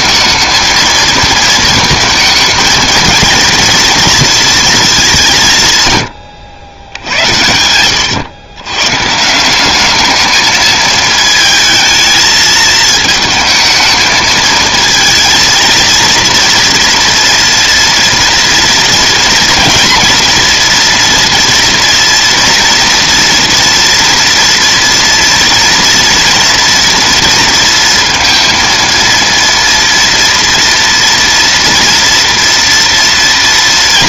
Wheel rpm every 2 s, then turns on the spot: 230, 230, 230, 90, 120, 220, 220, 220, 230, 230, 230, 230, 230, 230, 230, 230, 230.
none